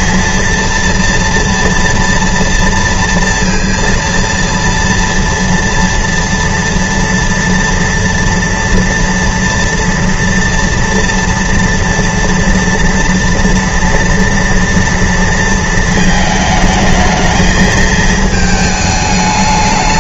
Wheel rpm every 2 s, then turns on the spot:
230, 230, 230, 240, 230, 230, 230, 230, 220, 210.
none